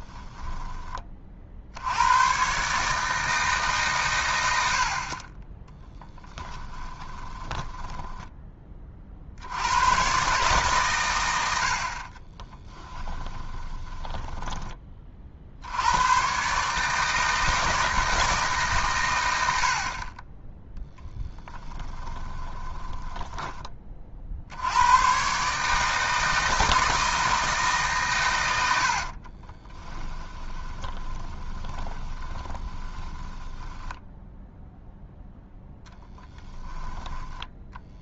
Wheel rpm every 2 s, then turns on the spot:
20, 140, 60, 20, 30, 130, 20, 30, 150, 140, 10, 20, 100, 160, 80, 20, 20, 0, 20.
6-8 12-14 22-24 30-34 36-38